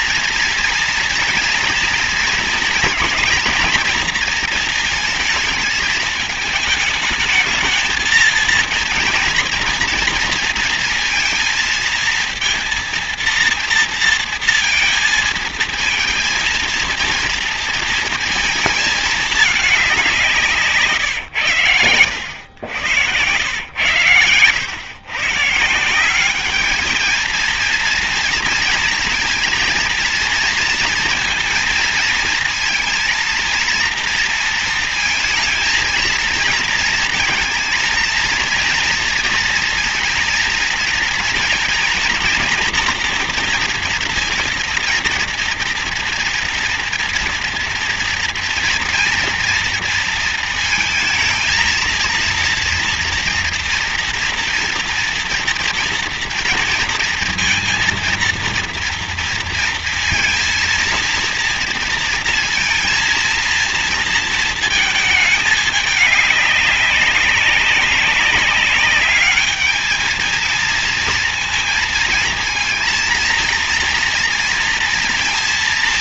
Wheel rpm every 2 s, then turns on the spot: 230, 230, 230, 220, 230, 230, 230, 230, 230, 220, 170, 90, 100, 190, 230, 230, 230, 230, 230, 230, 230, 230, 230, 230, 230, 230, 230, 230, 230, 230, 230, 230, 230, 200, 200, 220, 230, 230.
none